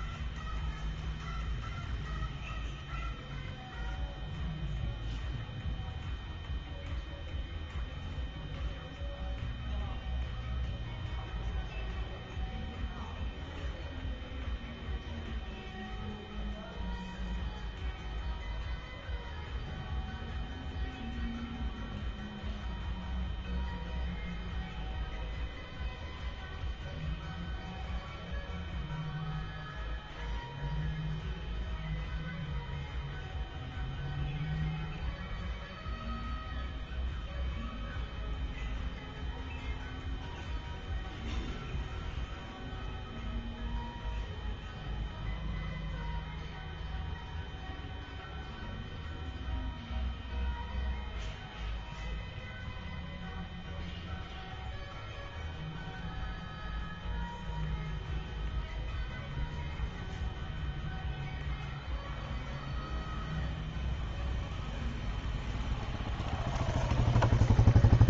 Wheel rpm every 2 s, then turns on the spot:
0, 0, 0, 0, 0, 0, 0, 0, 0, 0, 0, 0, 0, 0, 0, 0, 0, 0, 0, 0, 0, 0, 0, 0, 0, 0, 0, 0, 0, 0, 0, 0, 0, 0.
none